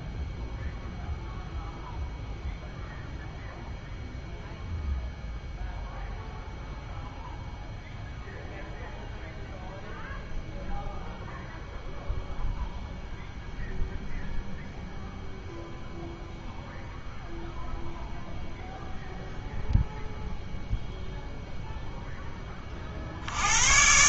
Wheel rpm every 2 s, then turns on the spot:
0, 0, 0, 0, 0, 0, 0, 0, 0, 0, 0, 20.
none